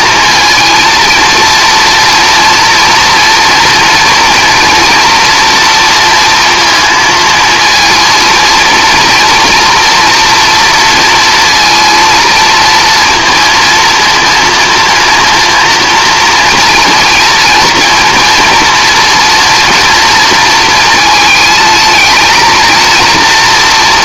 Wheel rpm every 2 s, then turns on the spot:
220, 240, 230, 230, 240, 230, 230, 230, 230, 230, 220, 230.
none